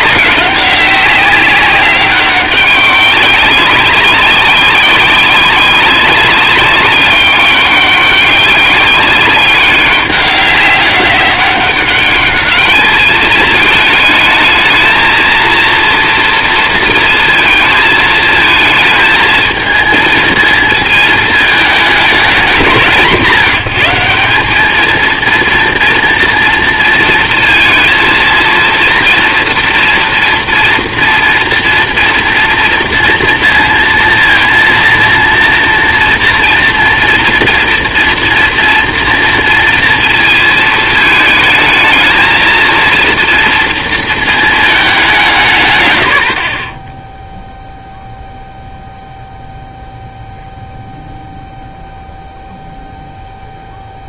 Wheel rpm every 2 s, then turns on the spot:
190, 200, 190, 190, 200, 200, 210, 220, 230, 220, 220, 170, 210, 230, 230, 230, 230, 230, 230, 230, 220, 230, 210, 40, 0, 0, 0.
none